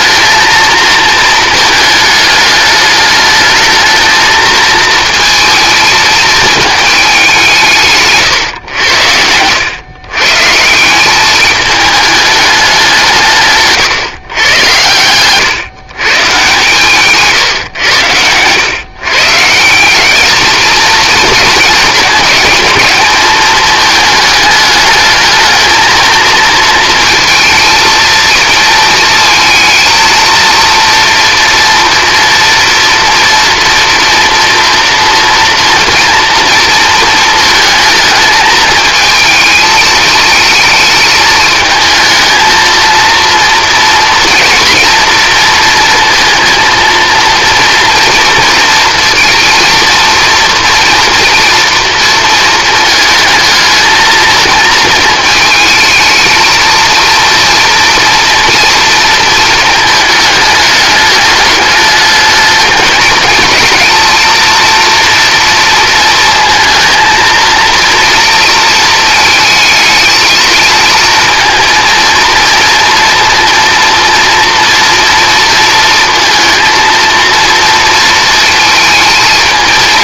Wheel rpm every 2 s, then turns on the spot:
220, 210, 220, 210, 90, 180, 190, 100, 130, 130, 220, 210, 210, 230, 230, 230, 230, 230, 230, 220, 220, 230, 240, 230, 230, 230, 220, 220, 230, 230, 210, 220, 230, 230, 220, 220, 230, 230, 230, 230.
14-16